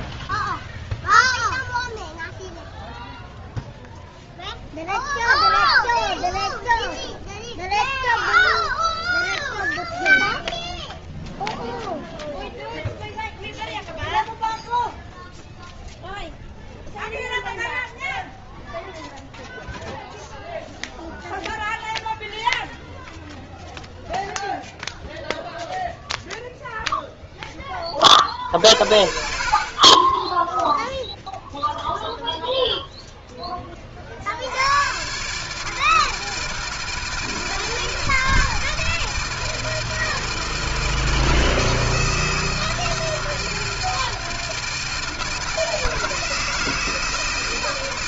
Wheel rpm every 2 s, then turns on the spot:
0, 0, 0, 0, 0, 0, 0, 0, 0, 0, 0, 0, 0, 40, 20, 0, 40, 160, 160, 160, 160, 160, 160, 160.
none